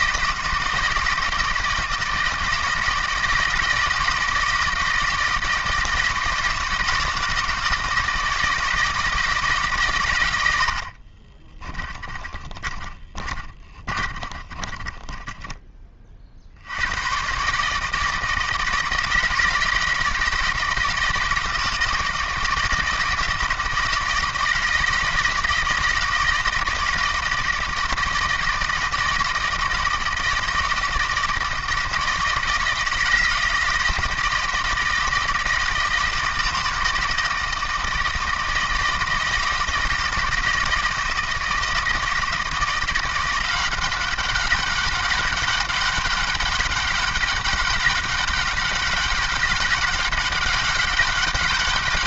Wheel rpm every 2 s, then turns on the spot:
160, 160, 160, 160, 160, 60, 20, 30, 70, 160, 170, 160, 160, 160, 160, 160, 170, 170, 160, 170, 170, 170, 190, 200, 200, 200.
10-16